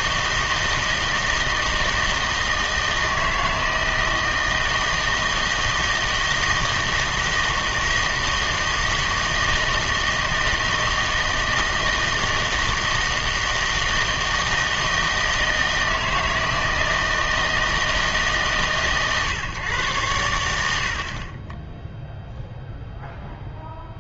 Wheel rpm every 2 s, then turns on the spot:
160, 160, 160, 160, 160, 160, 160, 160, 160, 140, 80, 0.
none